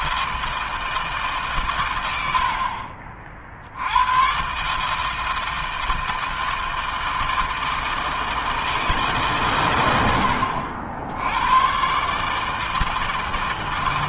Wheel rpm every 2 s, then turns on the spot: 160, 80, 130, 160, 160, 80, 150.
none